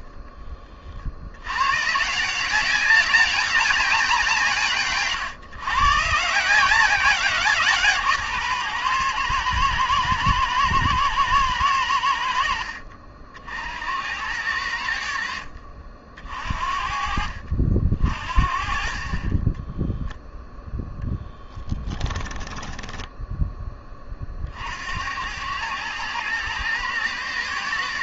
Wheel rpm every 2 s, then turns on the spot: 40, 190, 160, 180, 130, 110, 60, 80, 50, 40, 10, 10, 70, 110.
12-14 22-24